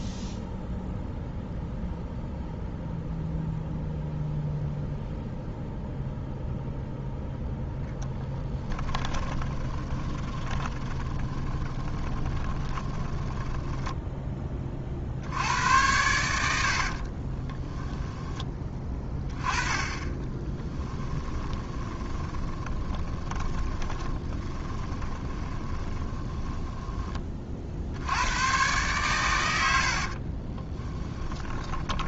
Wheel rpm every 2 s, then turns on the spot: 0, 0, 0, 0, 10, 30, 20, 40, 50, 20, 10, 20, 30, 20, 120, 20.
8-14 16-18 20-28 30-32